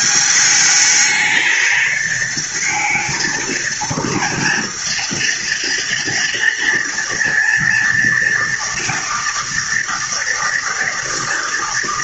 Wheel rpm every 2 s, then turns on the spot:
210, 230, 230, 230, 230, 230.
none